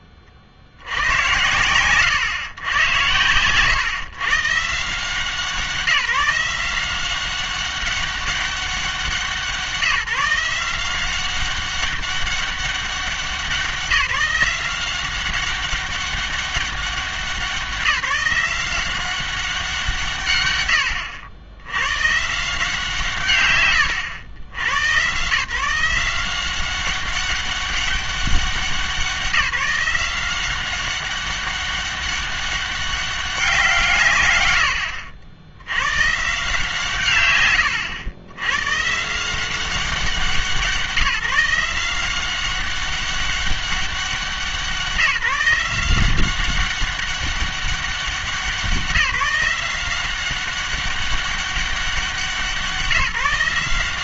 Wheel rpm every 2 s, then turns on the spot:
50, 110, 140, 170, 190, 170, 200, 180, 190, 180, 110, 160, 100, 190, 180, 190, 200, 70, 150, 110, 170, 190, 180, 190, 180, 190, 170.
none